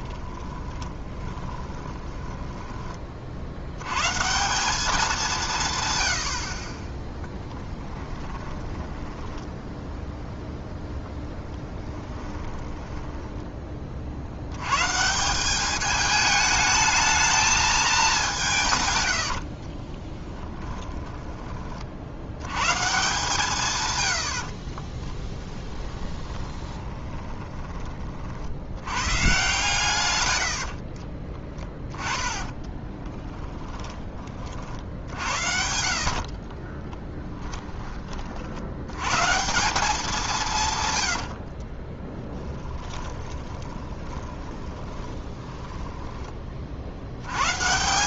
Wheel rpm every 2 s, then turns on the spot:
20, 10, 190, 30, 10, 0, 10, 100, 220, 150, 20, 130, 30, 20, 90, 60, 10, 50, 30, 80, 130, 10, 20, 50.
0-2 8-10 12-14 20-22 24-28 30-34 36-38 42-46